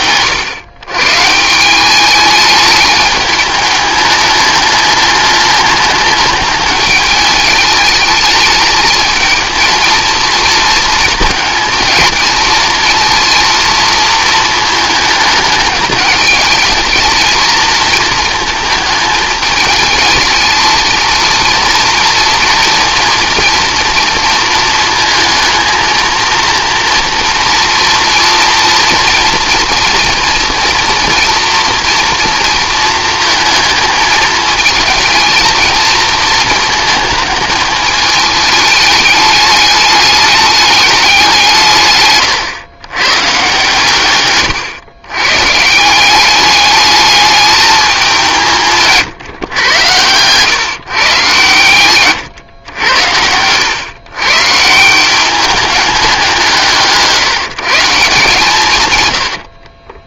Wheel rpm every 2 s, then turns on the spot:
120, 210, 210, 210, 220, 230, 230, 220, 220, 220, 230, 230, 220, 230, 230, 230, 230, 220, 230, 210, 210, 120, 130, 210, 150, 130, 90, 160, 170, 130.
none